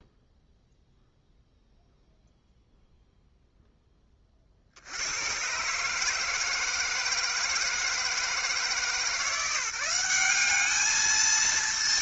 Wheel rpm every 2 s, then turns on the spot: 0, 0, 70, 160, 160, 220.
none